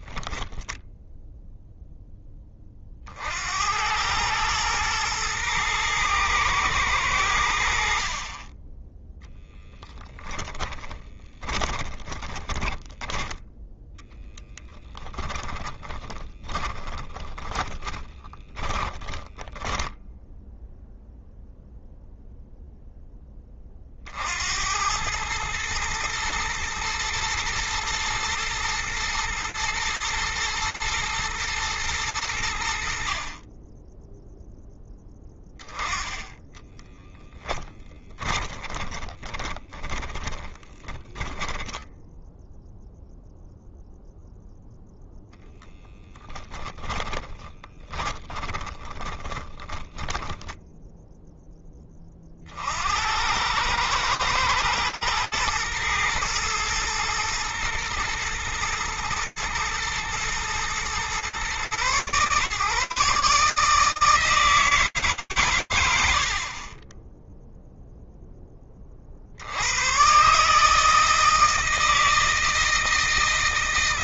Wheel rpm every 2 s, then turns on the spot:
0, 60, 110, 100, 20, 20, 10, 20, 30, 10, 0, 10, 100, 120, 110, 110, 60, 10, 10, 30, 10, 0, 10, 20, 10, 20, 110, 120, 110, 110, 120, 150, 110, 0, 100, 160, 160.
8-12 14-20 36-42 46-50